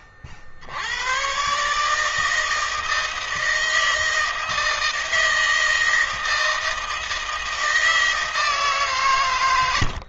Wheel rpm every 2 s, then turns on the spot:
60, 160, 160, 160, 160.
none